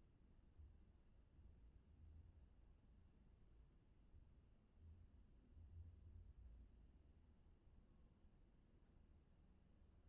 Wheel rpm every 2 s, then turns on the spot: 0, 0, 0, 0, 0.
none